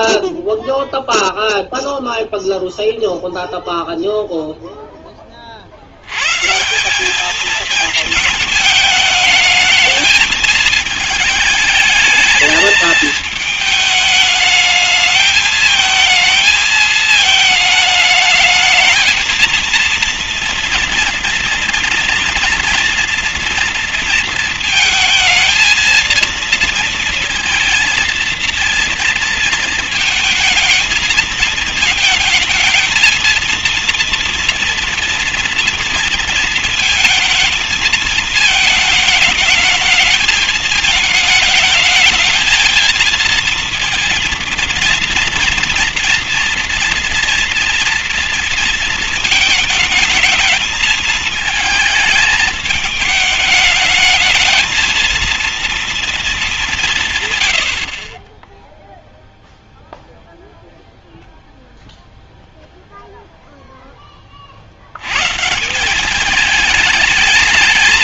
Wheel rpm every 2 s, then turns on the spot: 0, 0, 0, 140, 220, 220, 220, 210, 220, 220, 230, 230, 230, 230, 230, 220, 220, 240, 230, 220, 220, 220, 230, 240, 230, 220, 220, 220, 200, 10, 0, 0, 40, 210.
none